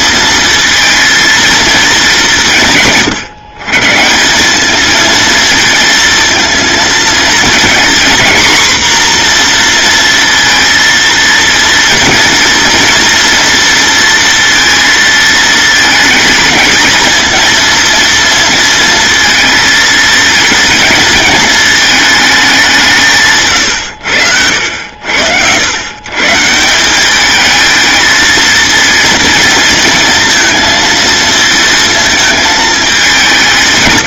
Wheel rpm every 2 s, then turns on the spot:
230, 140, 220, 230, 240, 230, 230, 230, 220, 230, 230, 160, 90, 190, 230, 230, 210.
none